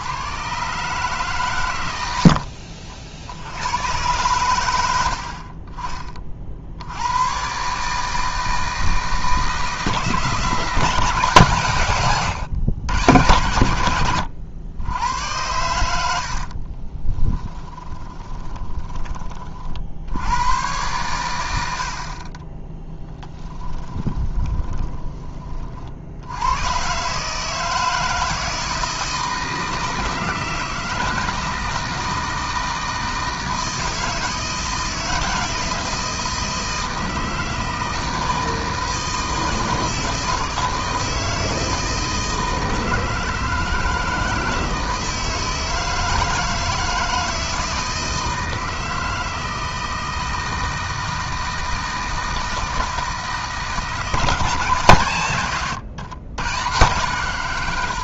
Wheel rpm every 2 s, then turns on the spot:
140, 50, 110, 70, 160, 170, 110, 90, 40, 20, 110, 10, 10, 110, 160, 160, 160, 160, 160, 160, 160, 160, 160, 160, 160, 160, 160, 130, 130.
16-20 22-26